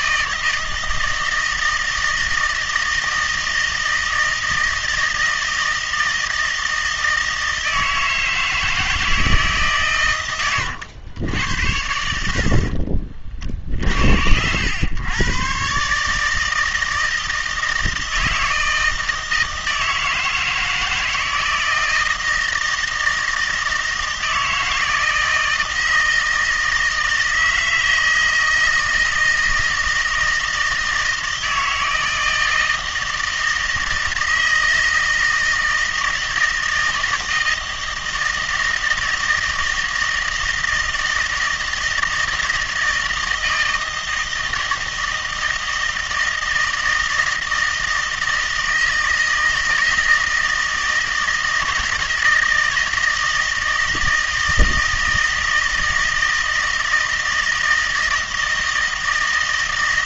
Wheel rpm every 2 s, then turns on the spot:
160, 160, 160, 160, 160, 110, 50, 90, 160, 160, 160, 160, 160, 160, 160, 160, 160, 160, 160, 160, 160, 160, 160, 160, 160, 160, 160, 160, 160, 160.
12-14